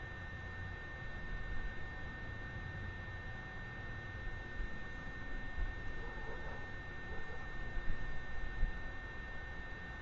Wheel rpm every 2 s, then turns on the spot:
0, 0, 0, 0, 0.
none